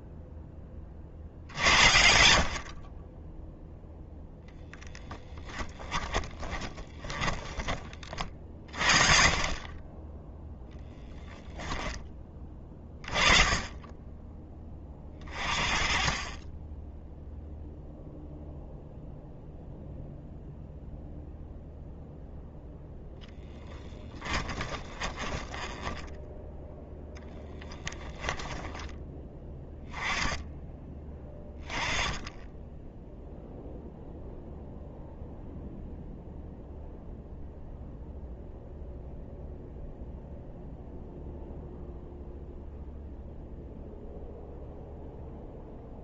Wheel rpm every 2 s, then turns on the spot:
50, 50, 10, 10, 40, 10, 20, 20, 10, 0, 0, 0, 10, 0, 10, 10, 10, 0, 0, 0, 0, 0, 0.
6-8 24-26